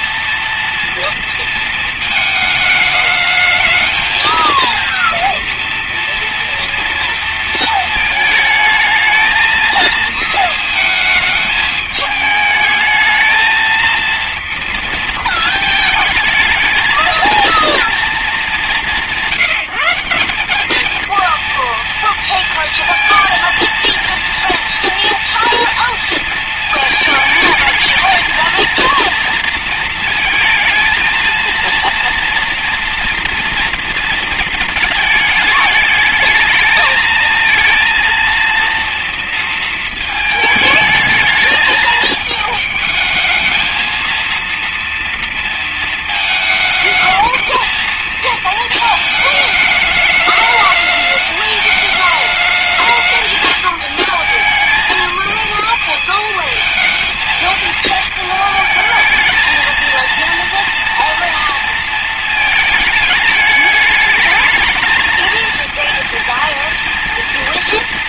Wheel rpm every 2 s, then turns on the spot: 240, 220, 220, 240, 220, 220, 220, 230, 220, 200, 210, 230, 230, 230, 220, 220, 230, 220, 220, 230, 220, 220, 230, 220, 220, 210, 220, 220, 220, 220, 230, 230, 210, 230.
none